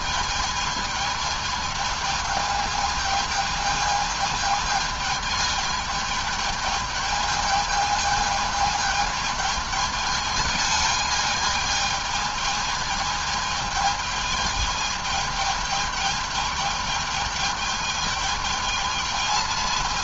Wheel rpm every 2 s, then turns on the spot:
210, 210, 220, 220, 220, 220, 220, 220, 210, 220.
none